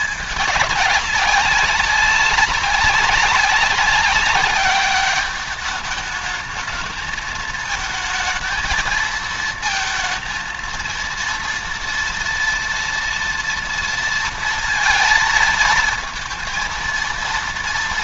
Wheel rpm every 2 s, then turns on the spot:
200, 190, 200, 210, 220, 230, 230, 230, 230.
none